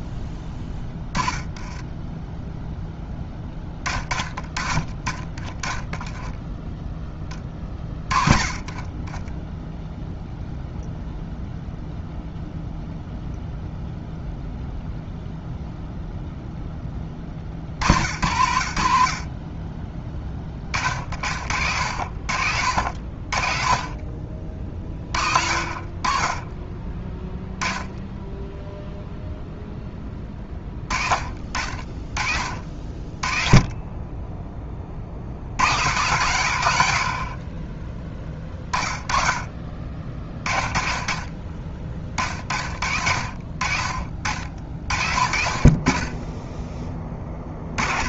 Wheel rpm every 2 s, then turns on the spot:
10, 10, 20, 10, 10, 0, 0, 0, 10, 70, 40, 60, 40, 20, 0, 20, 40, 40, 90, 30, 40, 60, 50, 20.
0-2 8-10